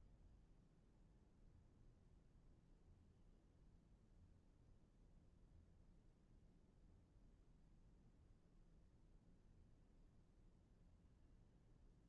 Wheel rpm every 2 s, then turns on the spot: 0, 0, 0, 0, 0, 0.
none